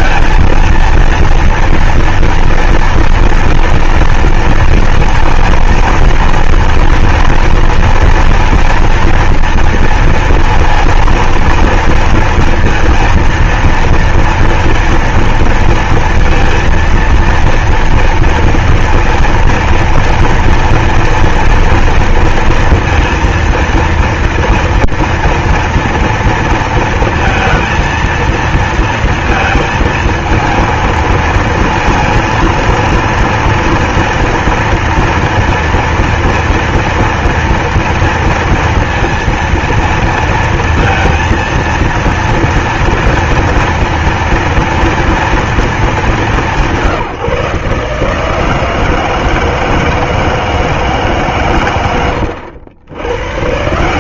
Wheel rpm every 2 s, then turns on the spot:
230, 230, 230, 230, 230, 230, 230, 230, 230, 230, 230, 230, 230, 230, 230, 230, 230, 230, 230, 230, 230, 230, 240, 210, 150, 160, 120.
none